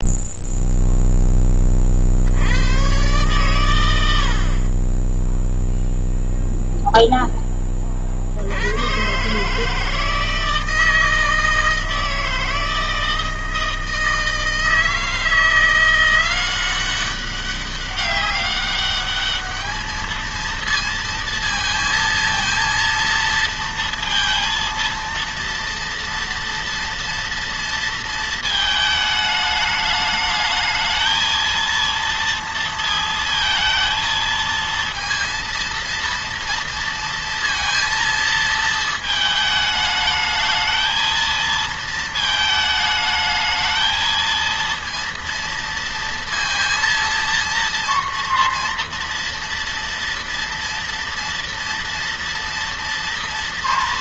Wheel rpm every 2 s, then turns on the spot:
0, 110, 20, 0, 110, 160, 160, 160, 190, 200, 230, 230, 230, 230, 220, 220, 230, 230, 230, 220, 220, 220, 230, 230, 230, 230, 230.
none